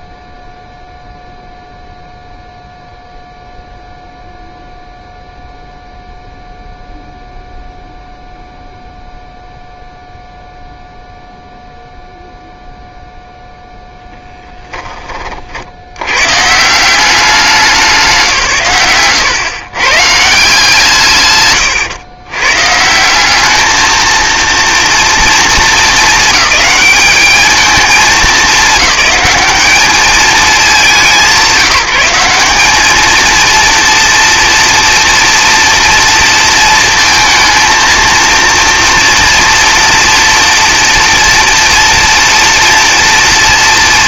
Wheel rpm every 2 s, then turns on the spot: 0, 0, 0, 0, 0, 0, 0, 10, 160, 140, 150, 150, 230, 220, 200, 200, 200, 240, 230, 230, 230, 230.
none